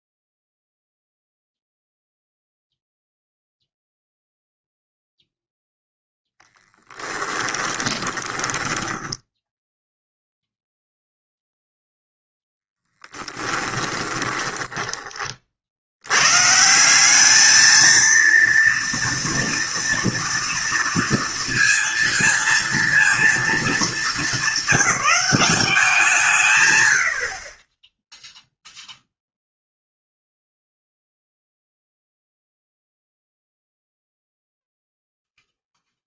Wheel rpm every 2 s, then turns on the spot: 0, 0, 0, 10, 10, 0, 10, 10, 150, 230, 230, 230, 210, 130, 0, 0, 0, 0.
8-10 14-16